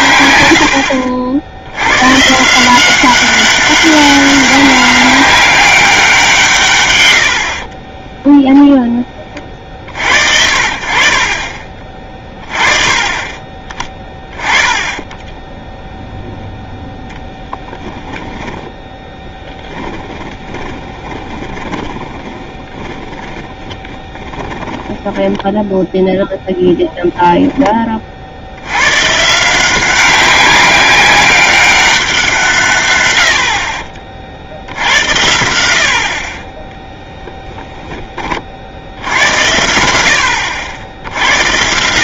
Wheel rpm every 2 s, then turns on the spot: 100, 160, 190, 150, 0, 60, 30, 20, 0, 10, 20, 20, 10, 0, 70, 190, 150, 70, 20, 50, 80.
14-16 18-26 36-38